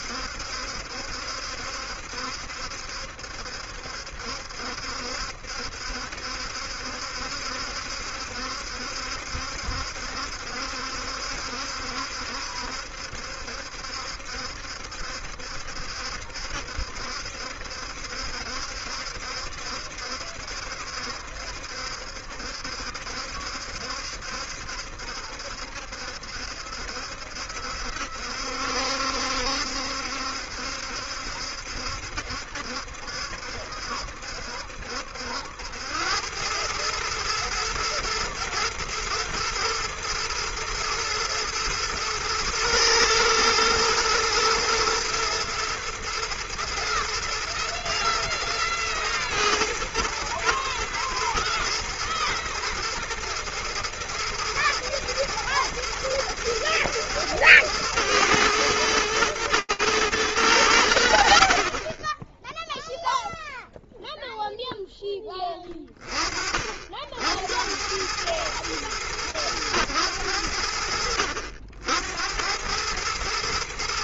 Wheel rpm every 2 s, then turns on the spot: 70, 70, 70, 70, 70, 70, 70, 70, 70, 70, 70, 70, 70, 70, 70, 70, 70, 70, 100, 110, 110, 110, 120, 120, 120, 110, 110, 120, 110, 120, 90, 0, 0, 30, 110, 90, 90.
none